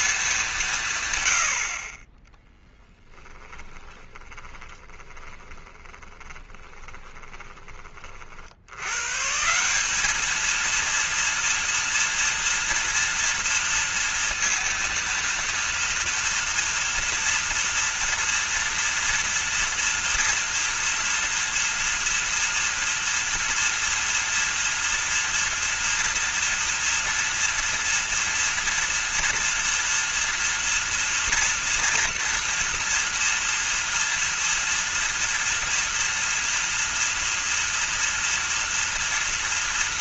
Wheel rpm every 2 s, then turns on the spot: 160, 0, 10, 30, 100, 230, 230, 230, 230, 230, 230, 230, 230, 230, 230, 230, 230, 230, 230, 230.
4-8